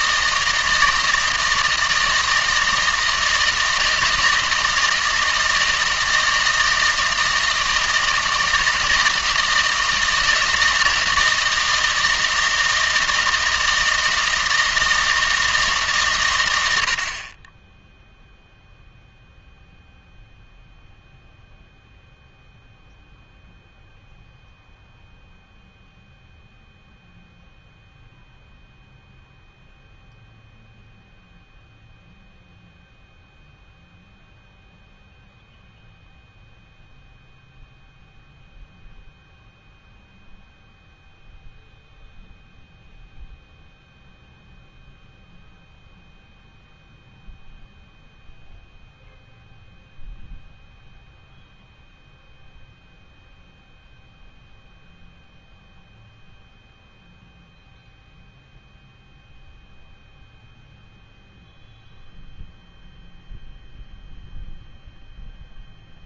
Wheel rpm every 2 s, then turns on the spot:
160, 160, 160, 160, 160, 160, 160, 160, 80, 0, 0, 0, 0, 0, 0, 0, 0, 0, 0, 0, 0, 0, 0, 0, 0, 0, 0, 0, 0, 0, 0, 0, 0.
none